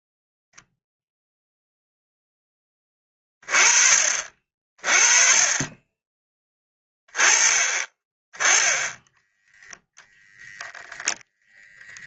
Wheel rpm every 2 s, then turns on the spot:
0, 10, 40, 20, 10, 0.
none